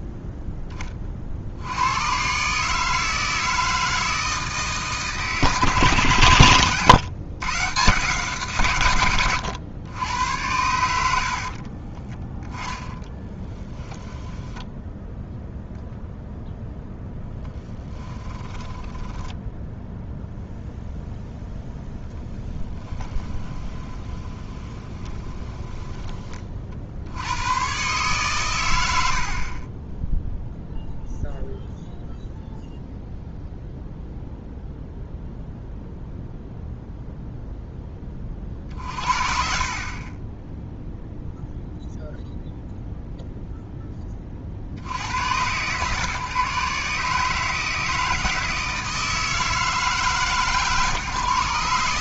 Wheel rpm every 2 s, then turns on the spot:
30, 150, 150, 120, 110, 80, 10, 0, 0, 10, 0, 10, 20, 60, 100, 0, 0, 0, 0, 50, 0, 0, 70, 140, 160, 150.
12-14 18-20 22-26